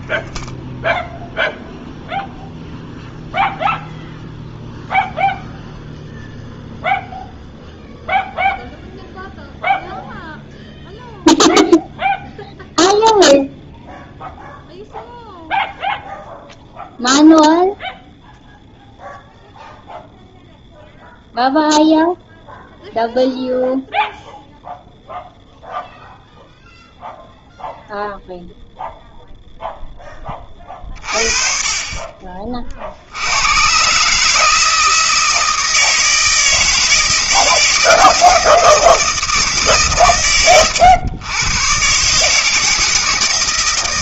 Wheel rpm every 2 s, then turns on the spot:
0, 0, 0, 0, 0, 0, 0, 0, 0, 0, 0, 0, 0, 0, 0, 30, 40, 160, 160, 160, 110, 160.
none